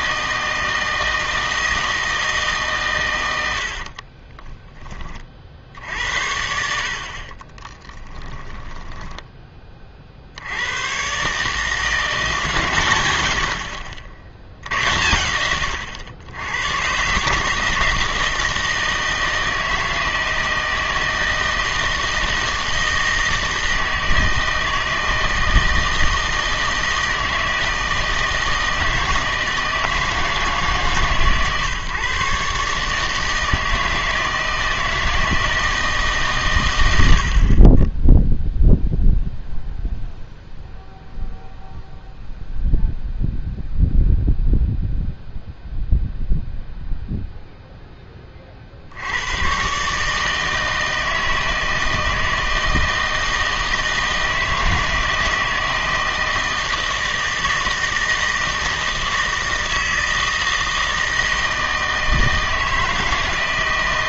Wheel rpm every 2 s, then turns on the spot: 160, 130, 20, 70, 10, 100, 130, 80, 110, 160, 160, 160, 160, 160, 160, 140, 150, 160, 100, 0, 0, 0, 0, 0, 60, 160, 160, 160, 160, 160, 160, 160.
8-10